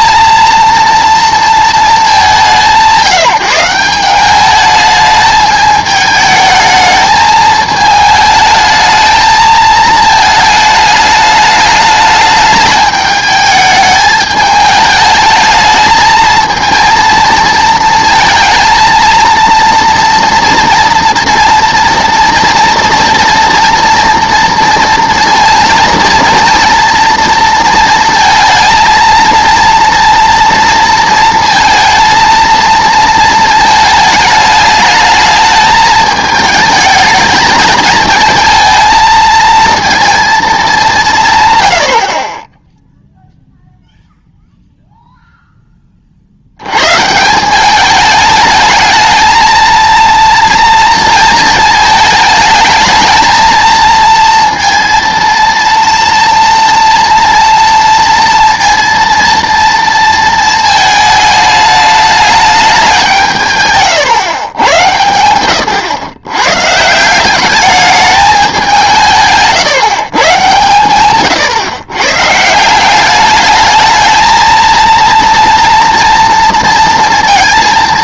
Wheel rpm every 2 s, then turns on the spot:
230, 180, 210, 220, 220, 220, 210, 210, 230, 230, 230, 230, 230, 240, 230, 230, 230, 210, 220, 220, 220, 10, 0, 90, 220, 230, 220, 230, 230, 230, 220, 200, 100, 140, 190, 120, 170, 230, 230.
none